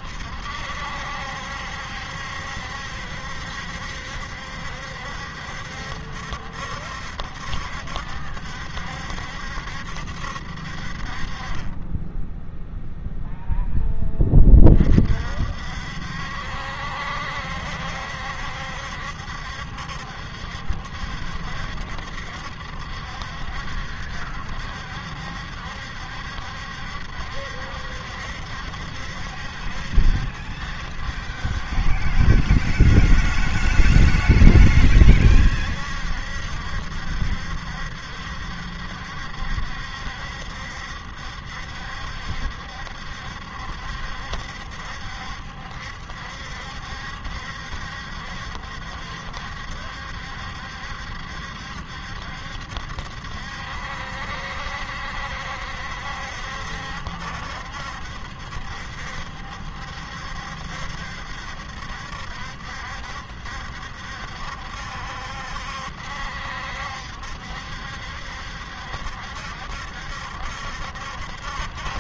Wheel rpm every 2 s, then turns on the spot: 70, 70, 70, 70, 60, 60, 0, 30, 70, 70, 70, 70, 70, 70, 70, 70, 70, 70, 70, 70, 70, 70, 70, 70, 70, 70, 70, 70, 70, 70, 70, 70, 70, 70, 70, 70.
none